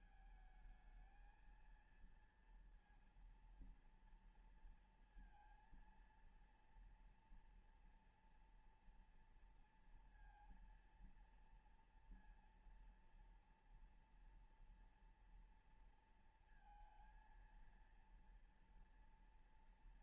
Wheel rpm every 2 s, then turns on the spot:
220, 230, 230, 230, 230, 230, 230, 240, 230, 230.
none